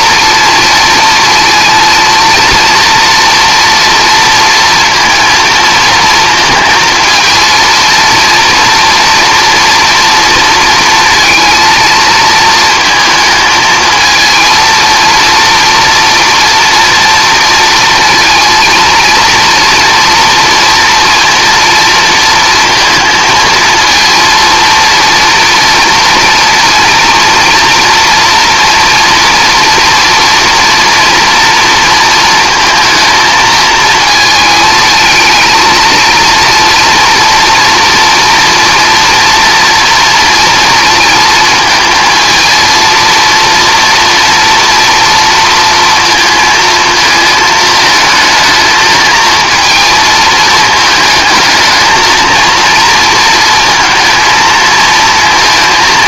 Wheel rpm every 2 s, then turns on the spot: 230, 230, 230, 230, 230, 230, 220, 230, 230, 230, 230, 230, 230, 230, 230, 230, 220, 220, 230, 230, 230, 230, 230, 230, 220, 220, 230, 230.
none